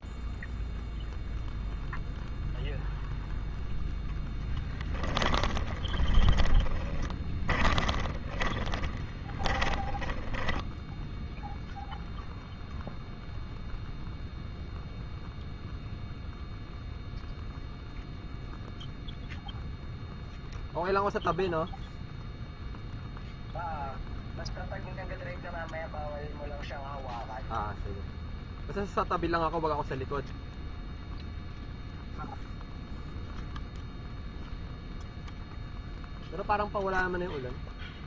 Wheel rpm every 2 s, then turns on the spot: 0, 0, 10, 30, 20, 10, 0, 0, 0, 0, 0, 0, 0, 0, 0, 0, 0, 0, 0.
4-12